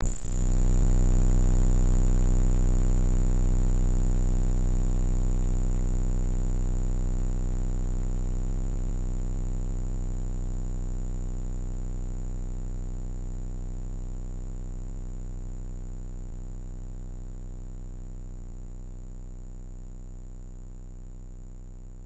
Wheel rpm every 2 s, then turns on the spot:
0, 0, 0, 0, 0, 0, 0, 0, 0, 0, 0.
none